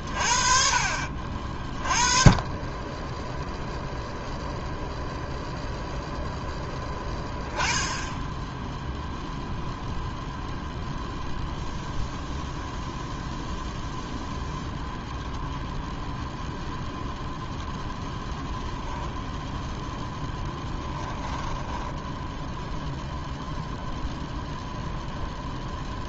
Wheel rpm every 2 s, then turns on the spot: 50, 0, 0, 10, 0, 0, 0, 0, 0, 0, 10, 0, 0.
20-22